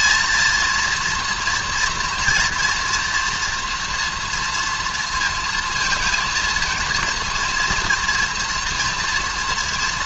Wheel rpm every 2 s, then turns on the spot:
240, 240, 230, 230, 230.
none